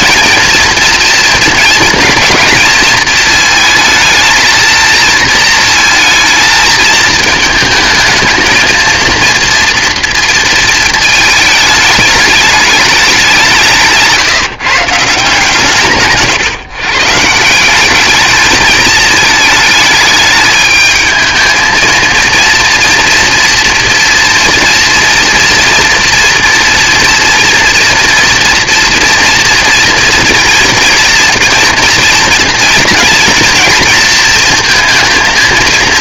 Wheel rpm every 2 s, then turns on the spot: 230, 230, 230, 220, 220, 220, 210, 150, 140, 220, 210, 240, 230, 230, 230, 230, 230, 230.
none